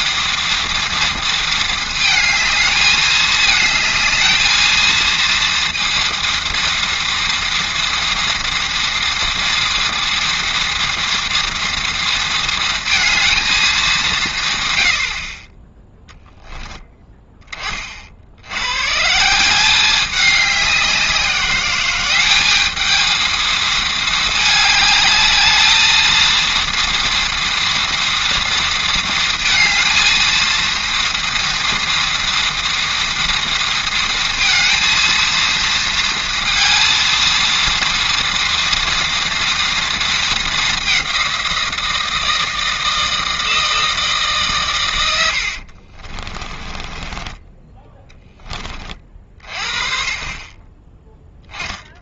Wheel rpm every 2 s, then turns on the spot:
230, 220, 220, 230, 230, 230, 230, 110, 10, 90, 200, 210, 210, 230, 230, 230, 240, 230, 230, 240, 200, 160, 130, 20, 20, 20.
46-48